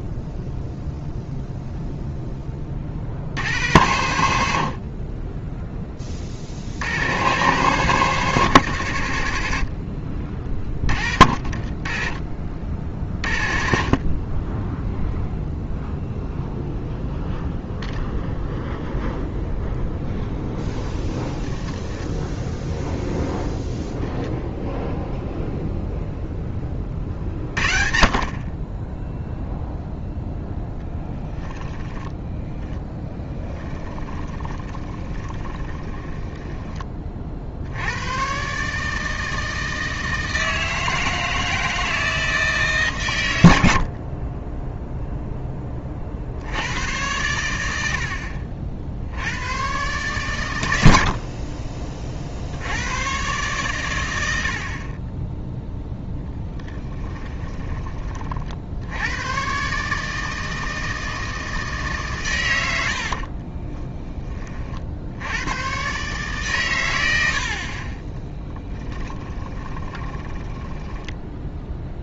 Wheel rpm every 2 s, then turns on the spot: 40, 10, 70, 50, 110, 30, 40, 10, 0, 0, 0, 0, 0, 20, 30, 10, 10, 20, 10, 140, 160, 140, 10, 90, 60, 100, 80, 50, 10, 70, 160, 90, 40, 120, 10, 10.
30-36 56-58 68-72